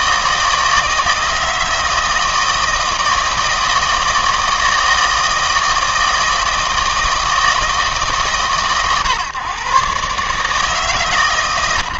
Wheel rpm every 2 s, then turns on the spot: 160, 160, 160, 160, 130, 150.
none